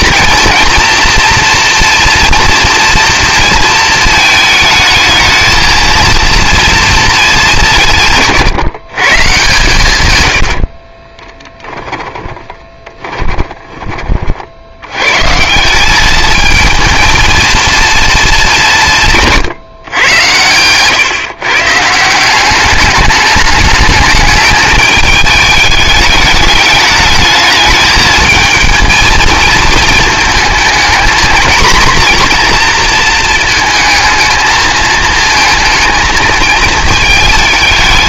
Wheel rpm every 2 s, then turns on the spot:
230, 230, 220, 230, 150, 60, 20, 70, 230, 190, 110, 200, 210, 210, 220, 220, 240, 220, 220.
10-14